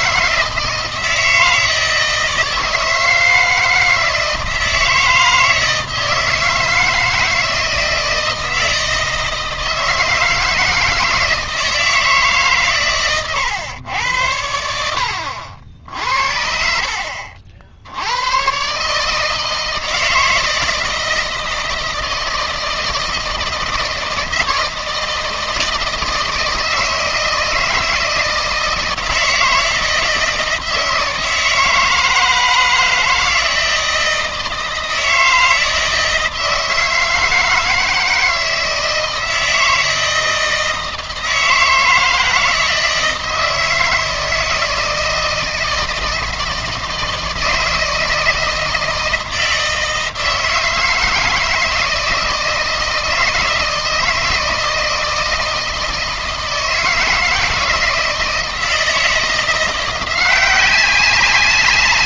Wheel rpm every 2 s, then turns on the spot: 160, 160, 160, 160, 160, 160, 130, 80, 60, 130, 160, 160, 160, 160, 160, 160, 160, 160, 160, 160, 160, 160, 160, 160, 160, 160, 160, 160, 160, 160, 180.
none